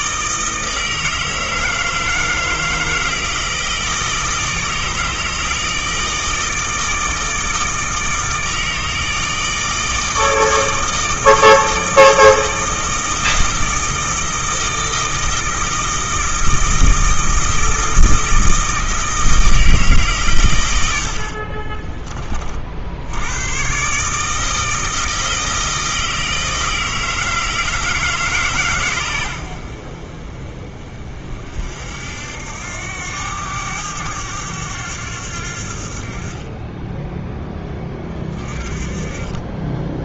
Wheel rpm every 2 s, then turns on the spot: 160, 160, 160, 160, 160, 160, 160, 160, 160, 160, 80, 80, 160, 160, 110, 40, 90, 90, 10, 30.
none